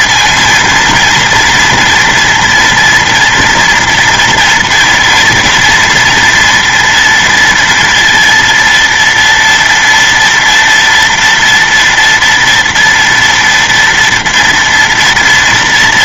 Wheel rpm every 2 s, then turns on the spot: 230, 230, 230, 240, 230, 230, 230, 230.
none